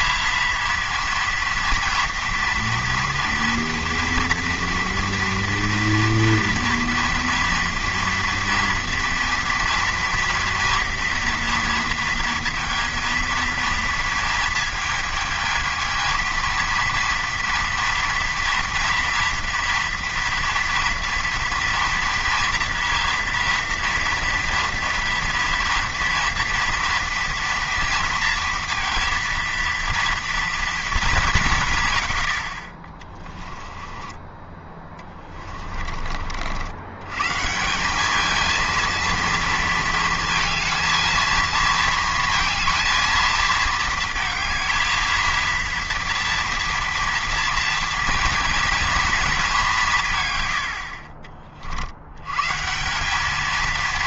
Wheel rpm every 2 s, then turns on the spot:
230, 230, 230, 230, 230, 230, 230, 220, 230, 230, 230, 230, 230, 230, 230, 230, 40, 20, 80, 230, 230, 230, 220, 230, 230, 100, 140.
none